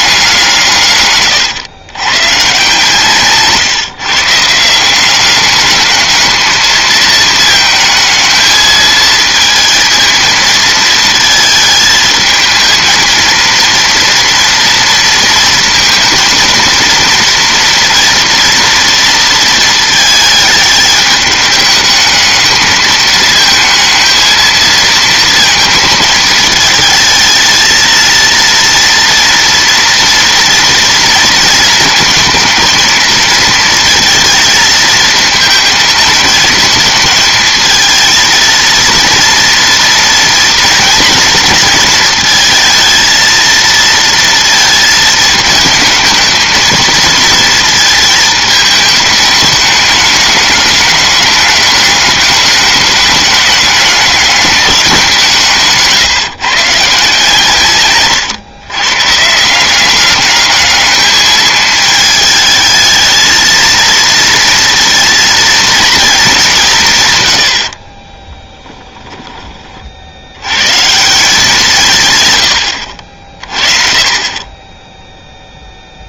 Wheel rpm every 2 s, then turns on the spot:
140, 140, 170, 220, 220, 220, 220, 230, 230, 230, 210, 220, 230, 220, 230, 230, 230, 220, 220, 230, 230, 230, 230, 220, 210, 210, 200, 190, 150, 120, 210, 220, 230, 160, 20, 130, 90, 10.
68-70